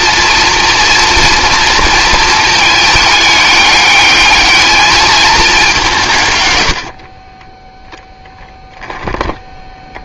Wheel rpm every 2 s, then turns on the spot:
230, 220, 220, 110, 10.
8-10